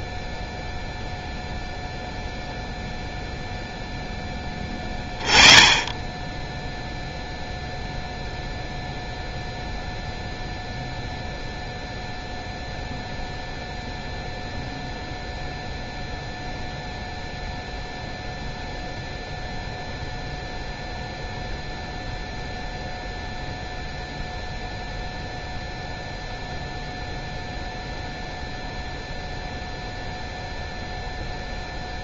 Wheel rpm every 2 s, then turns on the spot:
0, 0, 20, 0, 0, 0, 0, 0, 0, 0, 0, 0, 0, 0, 0, 0.
none